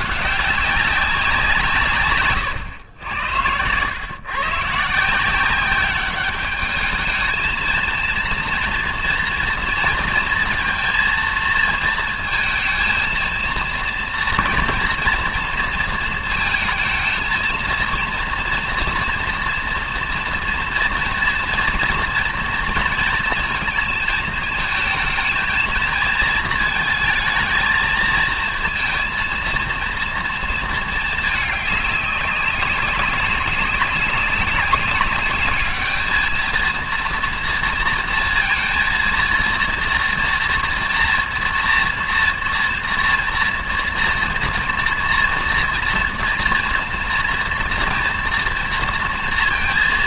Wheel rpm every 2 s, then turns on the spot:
200, 120, 130, 210, 230, 230, 230, 230, 230, 230, 230, 230, 220, 220, 230, 230, 200, 200, 220, 230, 230, 230, 230, 240, 240.
none